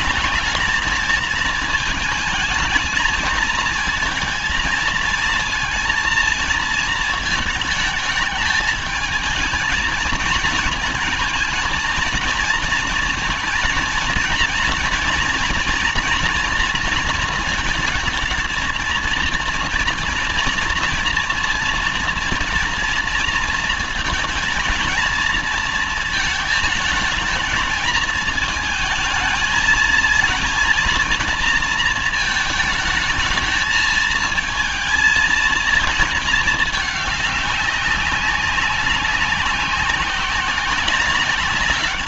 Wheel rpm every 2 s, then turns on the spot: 210, 220, 230, 230, 220, 230, 230, 230, 230, 230, 230, 230, 230, 220, 220, 230, 220, 230, 220, 200, 190.
none